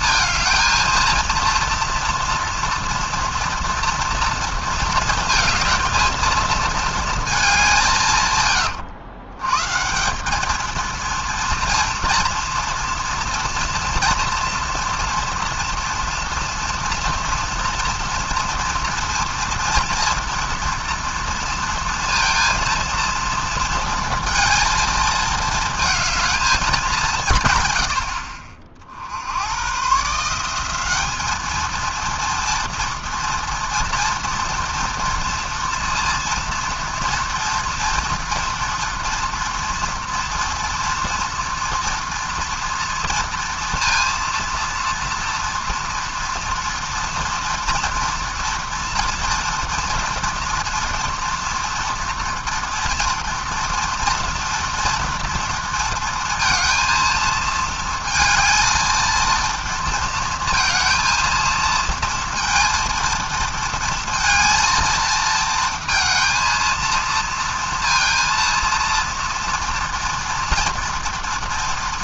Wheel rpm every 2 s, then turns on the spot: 230, 230, 230, 230, 100, 220, 230, 240, 230, 230, 230, 230, 220, 200, 50, 190, 230, 230, 230, 230, 230, 230, 230, 230, 230, 230, 240, 230, 230, 220, 230, 230, 230, 230, 230, 230.
none